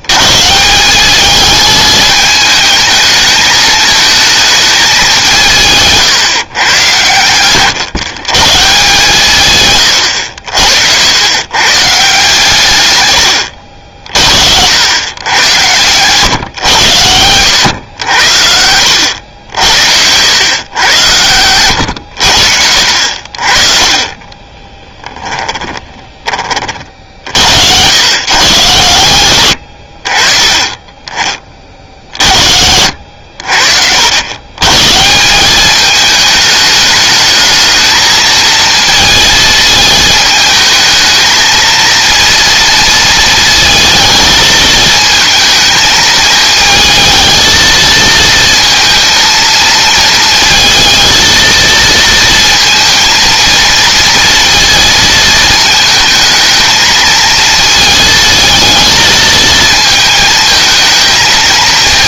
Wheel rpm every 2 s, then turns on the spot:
180, 220, 200, 120, 150, 80, 110, 100, 110, 80, 110, 60, 10, 50, 120, 20, 80, 160, 210, 230, 220, 230, 220, 220, 230, 230, 220, 230, 220, 220, 220.
12-14 22-26